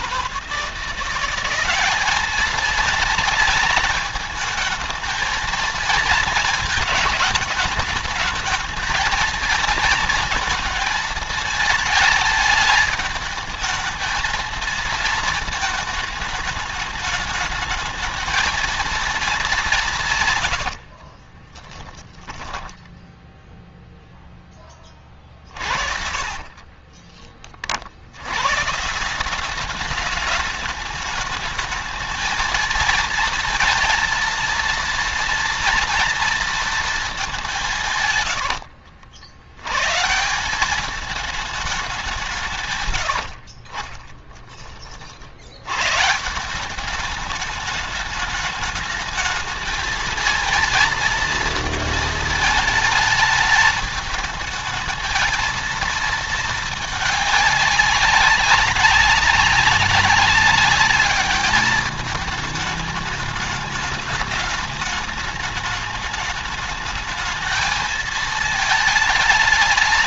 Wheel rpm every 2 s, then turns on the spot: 170, 220, 220, 220, 220, 220, 210, 230, 210, 220, 60, 0, 30, 30, 160, 210, 230, 230, 220, 80, 210, 100, 30, 190, 220, 230, 220, 220, 210, 190, 200, 210, 210, 220, 220.
20-22 26-28